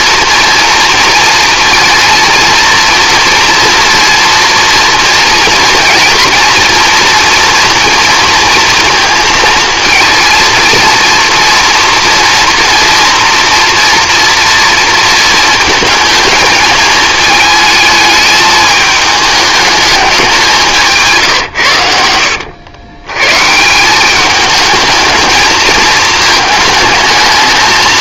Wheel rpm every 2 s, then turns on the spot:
230, 240, 230, 230, 230, 230, 230, 230, 220, 220, 170, 90, 210, 220.
none